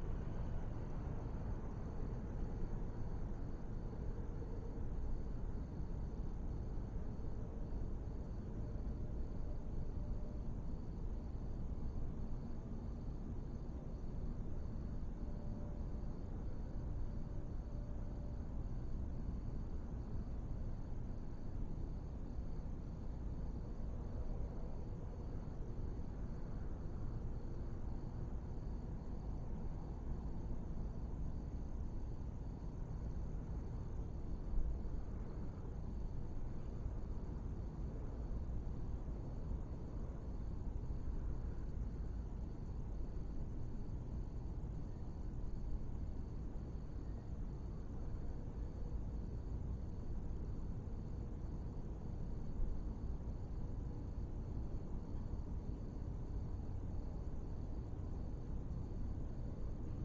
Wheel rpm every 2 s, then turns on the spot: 0, 0, 0, 0, 0, 0, 0, 0, 0, 0, 0, 0, 0, 0, 0, 0, 0, 0, 0, 0, 0, 0, 0, 0, 0, 0, 0, 0, 0, 0.
none